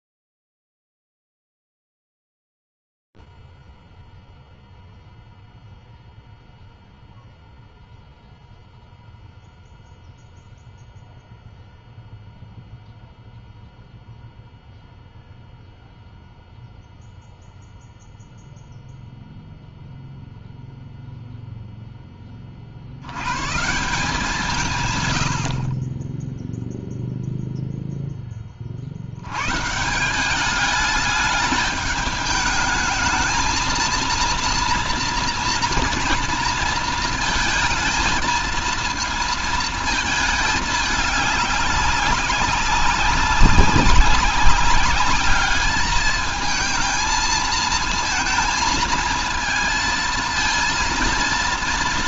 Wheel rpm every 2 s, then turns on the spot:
0, 0, 0, 0, 0, 0, 0, 0, 0, 0, 0, 70, 150, 0, 50, 210, 220, 230, 230, 230, 210, 200, 200, 230, 220, 230.
none